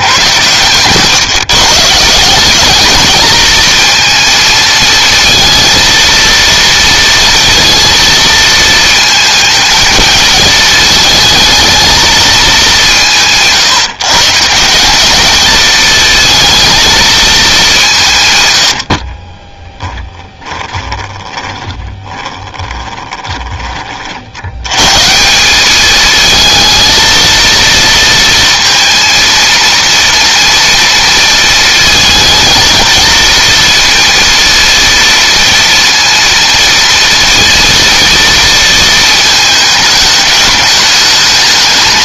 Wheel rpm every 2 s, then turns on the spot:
120, 210, 220, 230, 230, 220, 190, 180, 230, 100, 20, 20, 110, 220, 230, 230, 230, 230, 230, 230, 210.
18-24